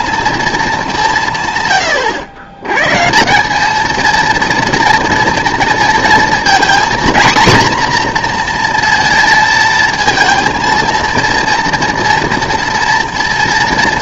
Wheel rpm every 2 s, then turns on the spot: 210, 120, 230, 230, 240, 230, 230.
none